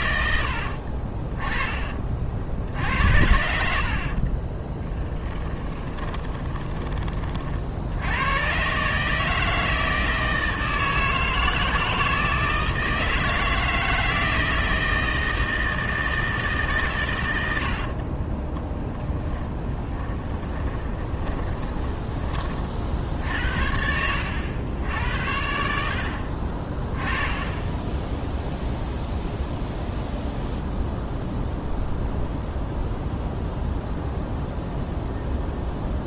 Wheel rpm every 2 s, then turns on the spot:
50, 70, 20, 20, 140, 160, 160, 160, 140, 30, 10, 40, 80, 20, 0, 0, 0, 0.
0-2 4-6 18-22